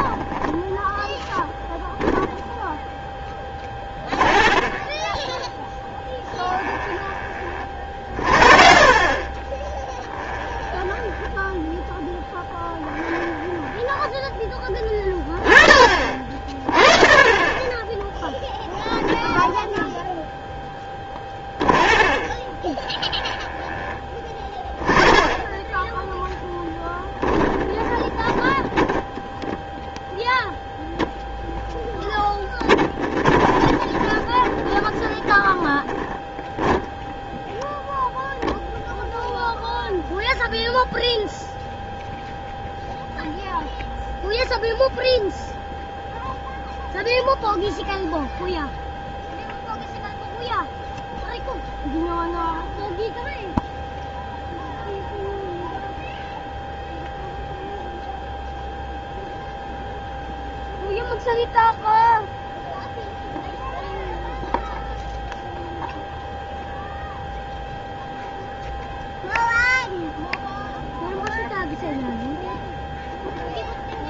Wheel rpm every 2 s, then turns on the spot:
10, 0, 30, 20, 40, 10, 10, 10, 30, 10, 10, 30, 20, 10, 10, 0, 10, 20, 10, 0, 0, 0, 0, 0, 0, 0, 0, 0, 0, 0, 0, 0, 0, 0, 0, 0, 0.
4-8 10-14 20-24 28-30 32-38